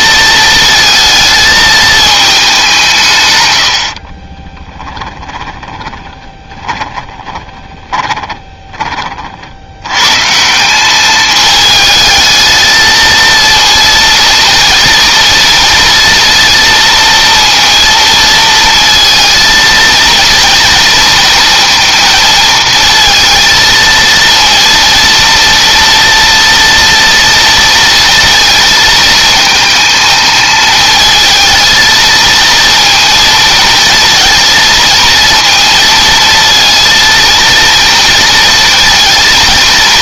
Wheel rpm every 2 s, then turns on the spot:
220, 150, 10, 20, 30, 200, 220, 230, 230, 230, 230, 230, 230, 230, 230, 220, 230, 230, 230, 230.
4-8